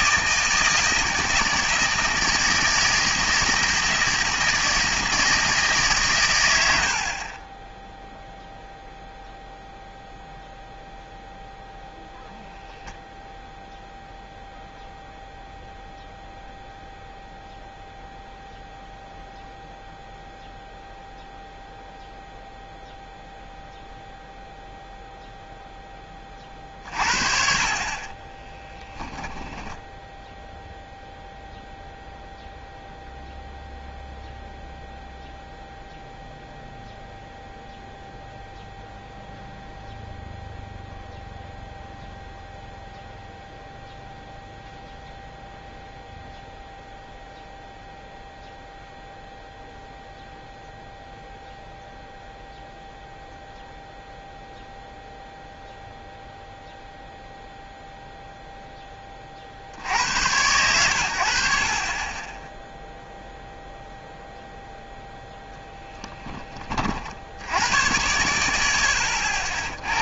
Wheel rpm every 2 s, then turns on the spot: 160, 160, 160, 70, 0, 0, 0, 0, 0, 0, 0, 0, 0, 40, 10, 0, 0, 0, 0, 0, 0, 0, 0, 0, 0, 0, 0, 0, 0, 10, 110, 0, 0, 40, 80.
28-30